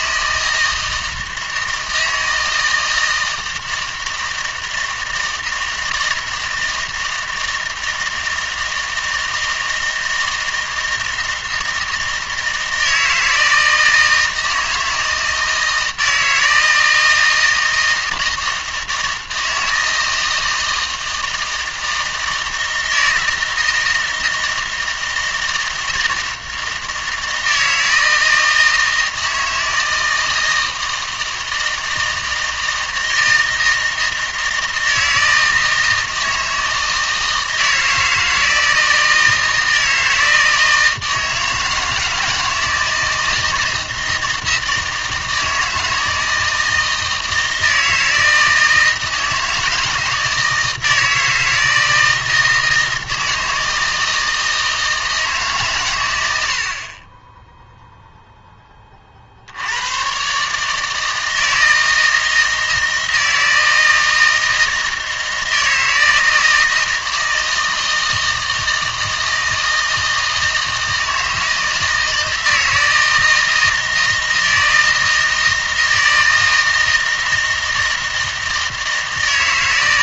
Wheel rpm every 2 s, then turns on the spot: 160, 160, 160, 160, 160, 160, 160, 160, 160, 160, 160, 160, 160, 160, 160, 160, 160, 160, 160, 160, 160, 160, 160, 160, 160, 160, 160, 160, 60, 20, 150, 160, 160, 160, 160, 160, 160, 160, 160, 160.
none